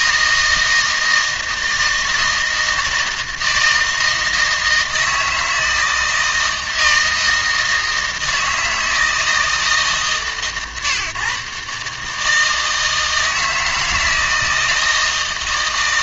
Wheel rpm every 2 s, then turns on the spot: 160, 160, 160, 160, 160, 130, 160, 160.
none